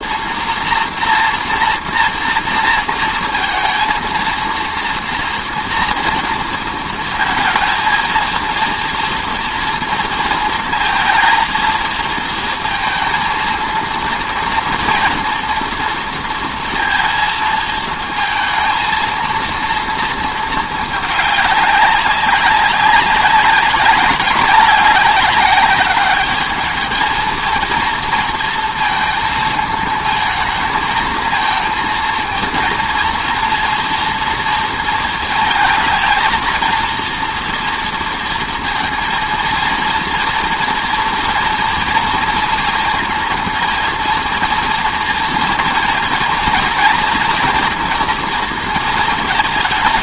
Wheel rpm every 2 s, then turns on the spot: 230, 230, 230, 230, 230, 230, 230, 230, 230, 220, 220, 200, 190, 210, 230, 220, 230, 230, 230, 230, 240, 230, 230, 230, 230.
none